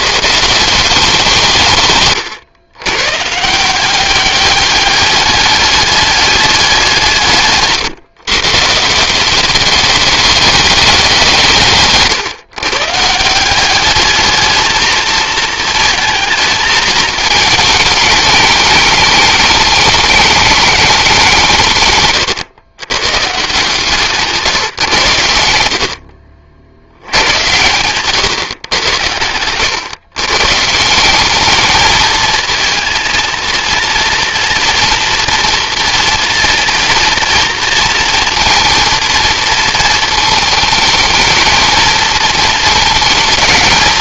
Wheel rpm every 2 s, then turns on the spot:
170, 120, 200, 190, 150, 200, 140, 220, 220, 210, 210, 120, 140, 80, 110, 150, 230, 230, 230, 230, 210, 220.
none